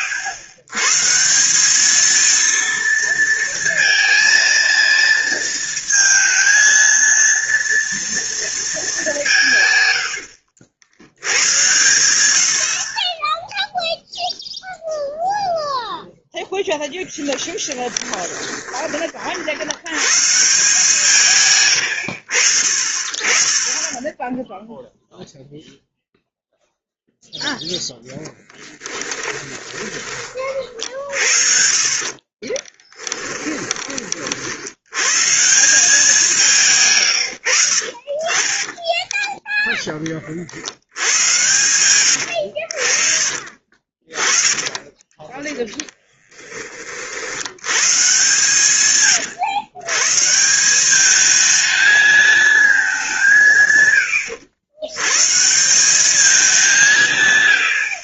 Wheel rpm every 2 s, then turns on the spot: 120, 230, 230, 230, 220, 80, 50, 0, 0, 20, 150, 50, 0, 0, 10, 50, 20, 80, 140, 20, 80, 70, 30, 30, 140, 190, 210, 110, 180.
32-34 38-40 42-46